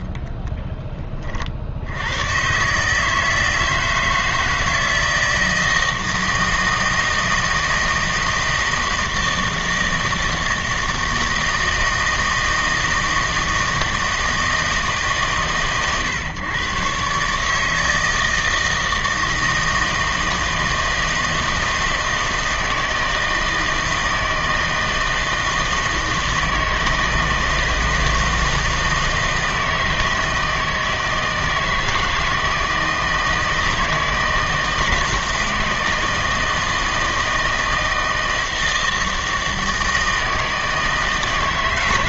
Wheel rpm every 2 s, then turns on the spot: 10, 140, 160, 160, 160, 160, 160, 160, 130, 160, 160, 160, 160, 160, 160, 160, 160, 160, 160, 160, 160.
none